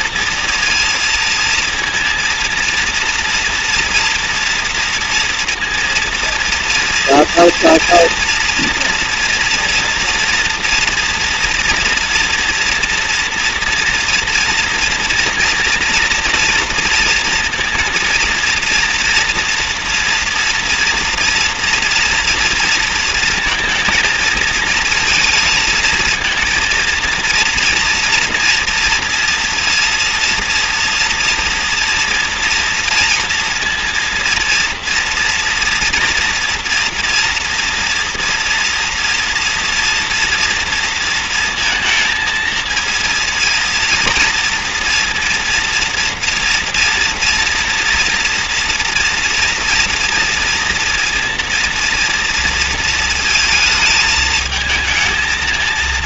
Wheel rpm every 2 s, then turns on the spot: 230, 230, 230, 230, 230, 230, 230, 240, 230, 230, 230, 230, 230, 230, 240, 240, 230, 230, 230, 230, 230, 230, 230, 230, 230, 230, 230, 220.
none